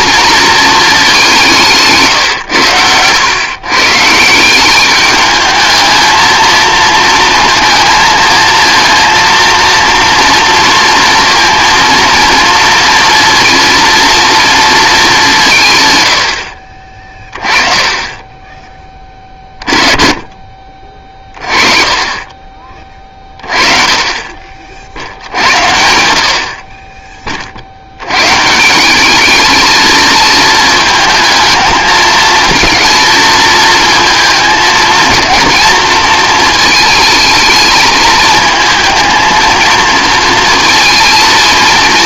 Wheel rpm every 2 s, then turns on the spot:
230, 120, 190, 220, 230, 230, 230, 220, 50, 20, 40, 30, 20, 50, 160, 220, 220, 230, 220, 220, 230.
none